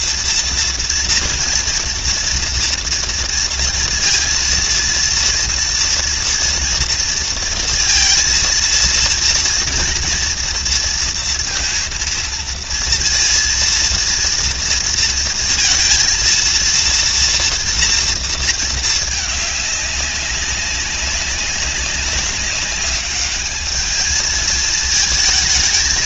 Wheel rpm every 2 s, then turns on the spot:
230, 230, 230, 230, 230, 230, 230, 230, 230, 210, 200, 210, 220.
none